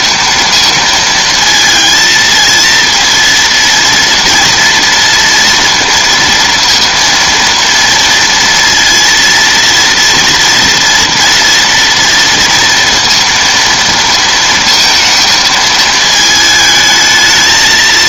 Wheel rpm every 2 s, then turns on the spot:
230, 230, 230, 230, 230, 230, 230, 230, 220.
none